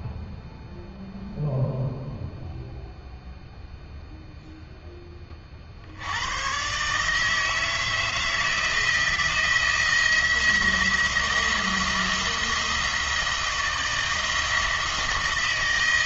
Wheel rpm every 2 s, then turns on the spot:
0, 0, 10, 140, 160, 170, 170, 170.
none